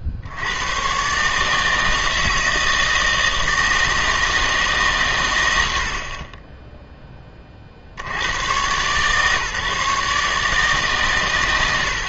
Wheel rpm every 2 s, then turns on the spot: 110, 160, 150, 10, 120, 140.
none